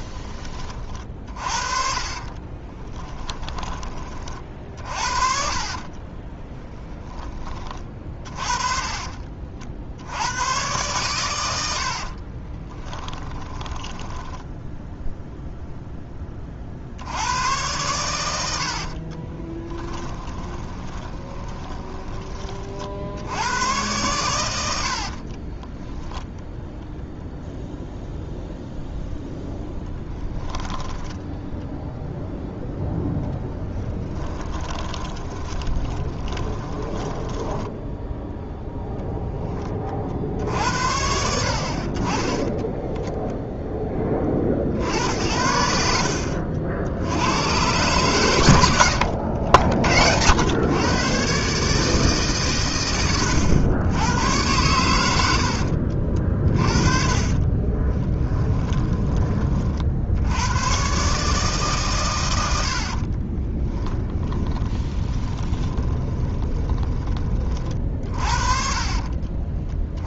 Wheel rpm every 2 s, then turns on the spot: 30, 20, 40, 10, 30, 110, 10, 0, 60, 70, 20, 60, 70, 0, 0, 10, 0, 20, 10, 0, 70, 10, 70, 70, 100, 110, 110, 100, 30, 20, 130, 70, 20, 30, 40.
2-6 8-10 12-14 18-22 24-26 30-32 34-38 48-50 56-60 62-66 68-70